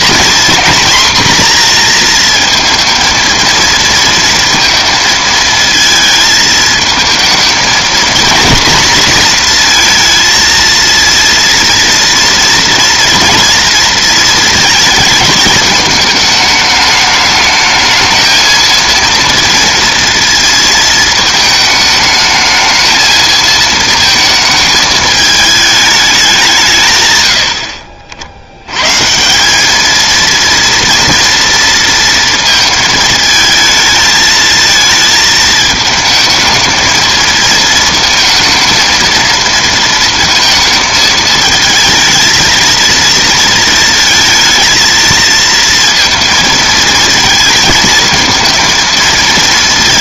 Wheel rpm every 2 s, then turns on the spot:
240, 230, 230, 220, 240, 230, 230, 220, 210, 230, 230, 220, 220, 160, 90, 230, 230, 220, 220, 230, 220, 220, 220, 230, 230.
none